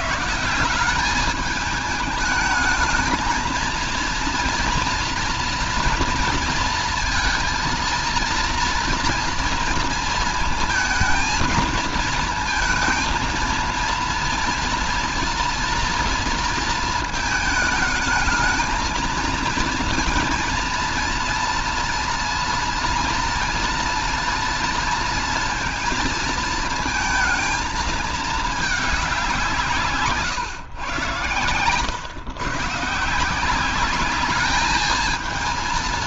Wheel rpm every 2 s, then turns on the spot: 170, 220, 230, 230, 230, 220, 230, 230, 230, 220, 230, 230, 230, 230, 210, 140, 140, 210.
none